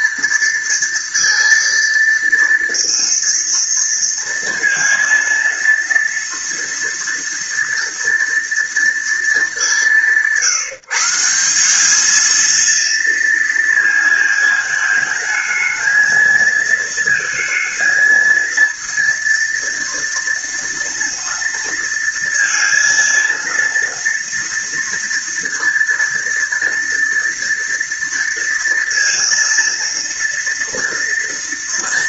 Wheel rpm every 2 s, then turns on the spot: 230, 230, 230, 230, 220, 170, 230, 220, 230, 230, 230, 230, 230, 230, 230, 230.
none